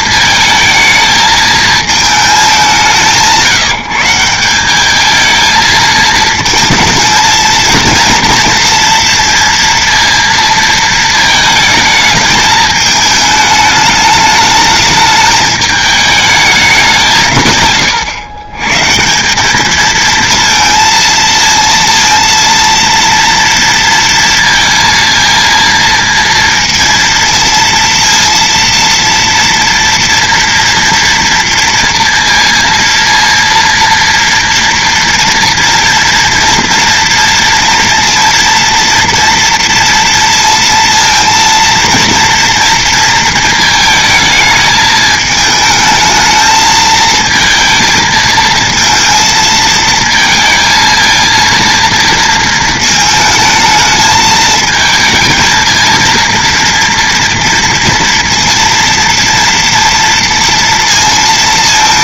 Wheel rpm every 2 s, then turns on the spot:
220, 200, 190, 230, 230, 230, 220, 210, 210, 130, 220, 230, 230, 230, 230, 230, 230, 230, 230, 230, 230, 230, 220, 220, 220, 220, 230, 220, 230, 230, 230.
none